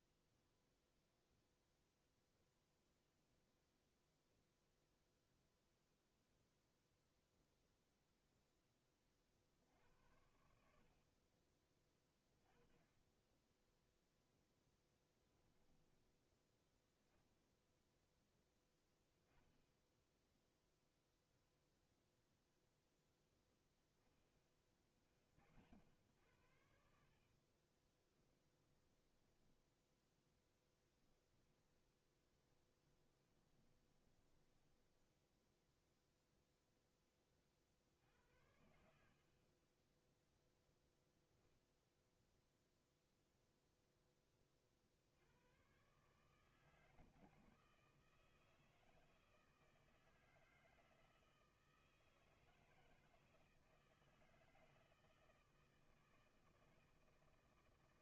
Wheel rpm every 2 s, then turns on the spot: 0, 0, 0, 0, 10, 60, 20, 10, 0, 20, 0, 0, 20, 60, 10, 10, 20, 10, 0, 70, 10, 0, 50, 160, 160, 160, 160, 160, 160.
14-16 28-36